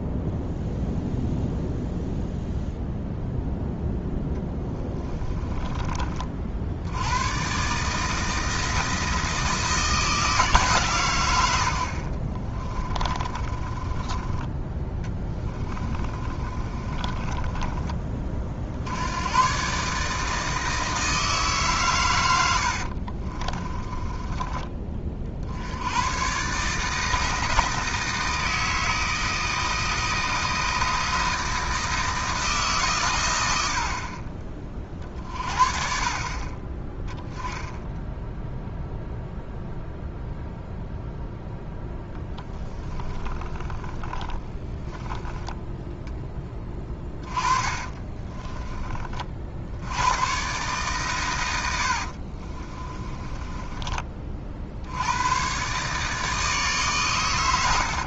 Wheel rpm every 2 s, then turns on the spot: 0, 0, 10, 70, 160, 130, 20, 10, 30, 70, 160, 70, 30, 150, 160, 160, 140, 40, 20, 0, 0, 10, 20, 20, 30, 130, 30, 80, 130.
4-6 12-14 16-18 22-24 42-48 52-54